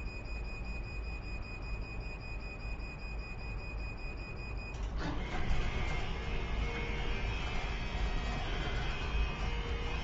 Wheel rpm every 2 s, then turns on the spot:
0, 0, 0, 0, 0.
none